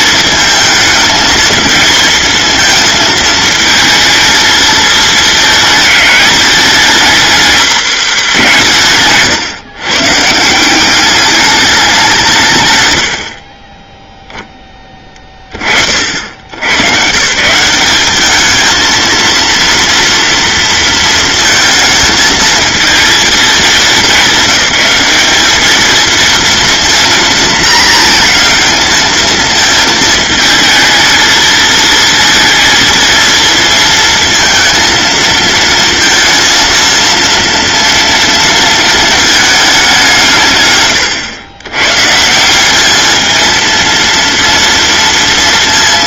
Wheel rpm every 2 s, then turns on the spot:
220, 230, 220, 210, 160, 170, 150, 10, 100, 220, 230, 220, 210, 230, 220, 220, 230, 230, 230, 230, 130, 190, 230.
none